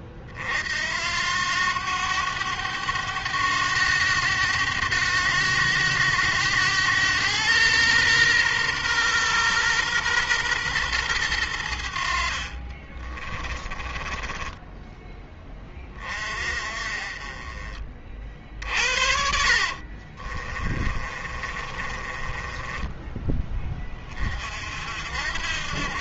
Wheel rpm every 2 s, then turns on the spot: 60, 100, 100, 100, 120, 120, 40, 10, 30, 60, 40, 20, 50.
12-16 18-24